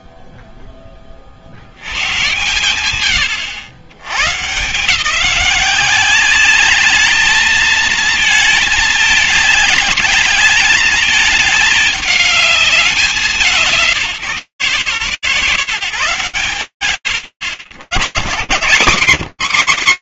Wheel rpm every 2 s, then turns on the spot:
30, 130, 130, 200, 220, 210, 200, 140, 140, 140.
none